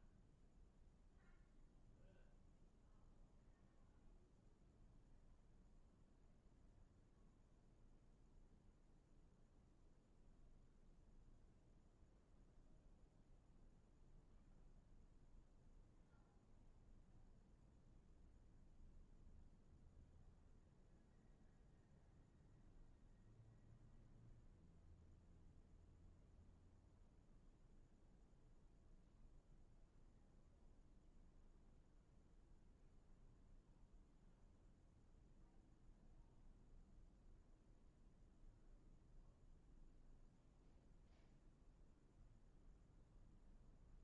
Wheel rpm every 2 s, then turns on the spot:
0, 0, 0, 0, 0, 0, 0, 0, 0, 0, 0, 0, 0, 0, 0, 0, 0, 0, 0, 0, 0, 0.
none